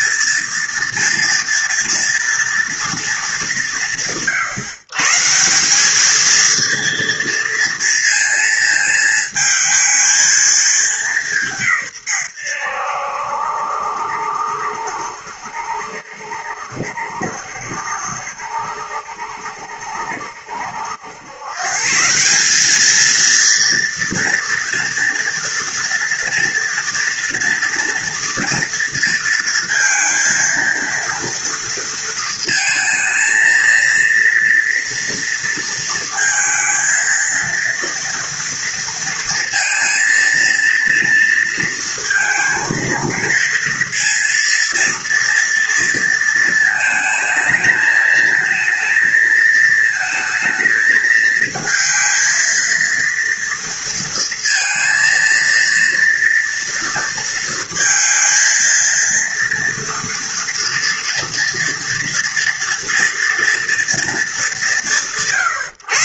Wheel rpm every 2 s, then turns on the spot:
230, 230, 140, 230, 220, 200, 80, 70, 70, 70, 90, 210, 230, 230, 230, 230, 220, 230, 220, 230, 230, 230, 230, 220, 220, 220, 230, 230, 230, 230, 230, 230, 150.
none